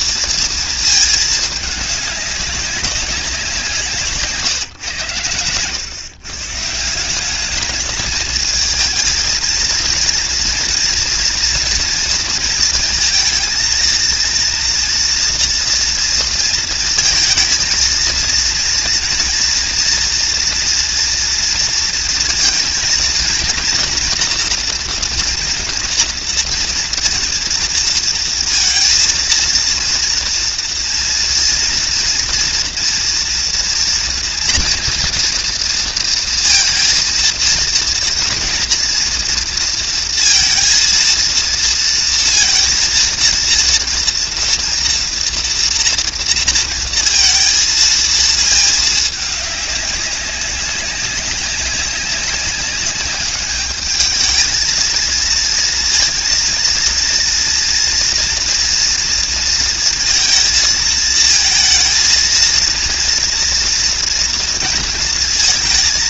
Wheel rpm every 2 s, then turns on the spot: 230, 200, 160, 140, 220, 230, 230, 230, 230, 230, 230, 230, 230, 230, 230, 230, 230, 230, 230, 230, 230, 230, 230, 230, 220, 200, 200, 220, 230, 230, 230, 230, 230.
none